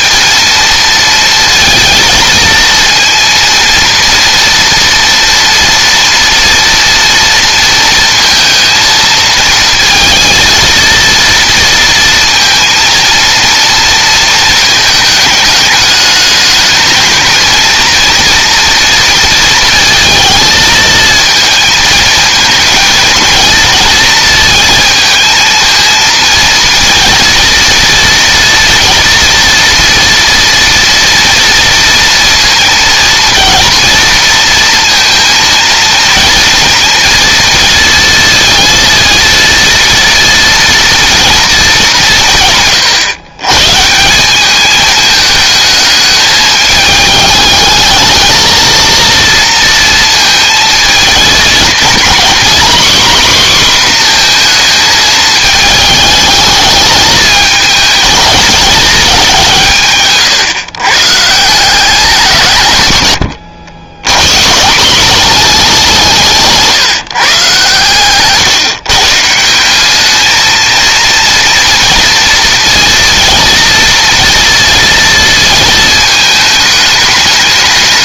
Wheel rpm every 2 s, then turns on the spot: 230, 230, 230, 230, 230, 230, 230, 220, 220, 230, 220, 220, 230, 230, 240, 230, 230, 230, 240, 230, 230, 140, 200, 210, 220, 220, 240, 230, 210, 220, 140, 120, 150, 160, 140, 230, 230, 230, 220.
none